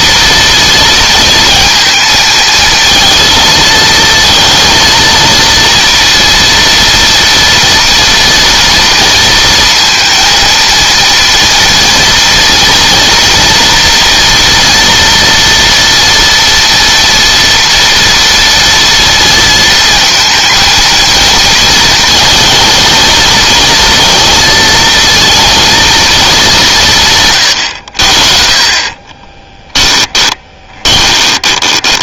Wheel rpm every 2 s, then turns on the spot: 230, 230, 230, 230, 230, 230, 240, 230, 230, 230, 230, 230, 230, 160, 30, 20.
28-32